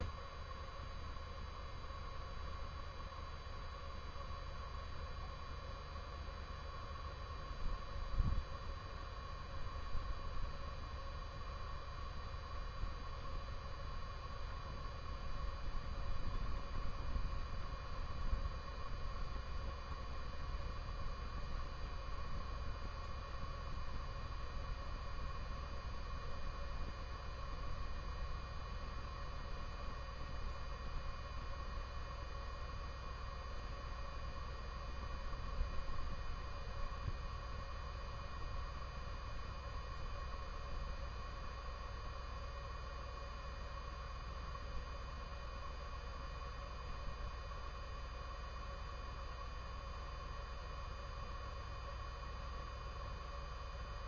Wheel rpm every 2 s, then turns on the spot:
0, 0, 0, 0, 0, 0, 0, 0, 0, 0, 0, 0, 0, 0, 0, 0, 0, 0, 0, 0, 0, 0, 0, 0, 0, 0, 0.
none